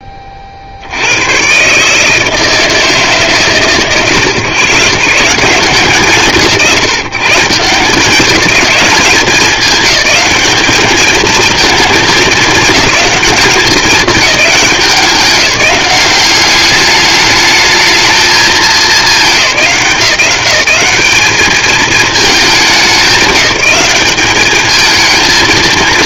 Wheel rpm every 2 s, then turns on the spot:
80, 150, 150, 150, 200, 220, 210, 190, 210, 210, 200, 200, 220.
none